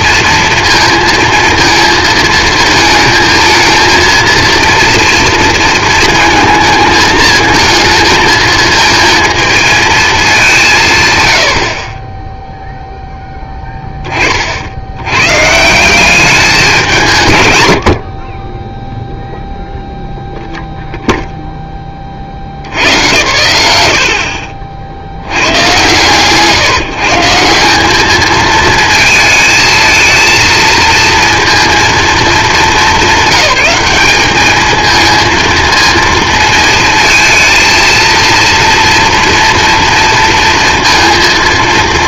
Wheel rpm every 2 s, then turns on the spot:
230, 220, 230, 220, 230, 170, 0, 60, 190, 10, 0, 80, 60, 150, 220, 230, 210, 210, 220, 230, 230.
none